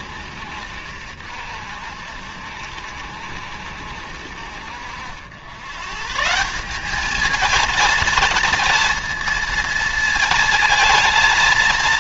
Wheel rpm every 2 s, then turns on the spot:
60, 70, 80, 200, 230, 230.
none